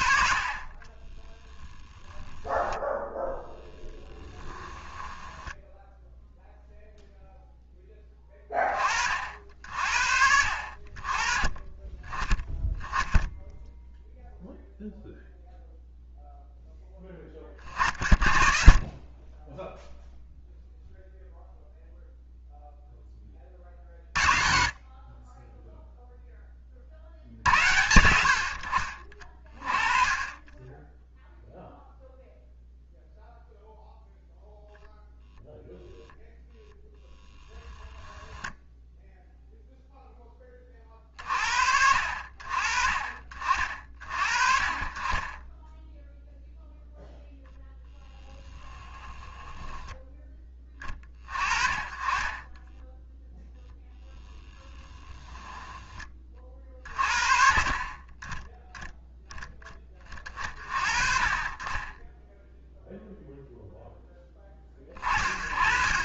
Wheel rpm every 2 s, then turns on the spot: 40, 10, 10, 0, 30, 50, 10, 0, 0, 30, 0, 0, 40, 40, 60, 10, 0, 0, 0, 10, 30, 40, 30, 0, 10, 20, 10, 10, 40, 0, 30, 0, 20.
4-6 48-50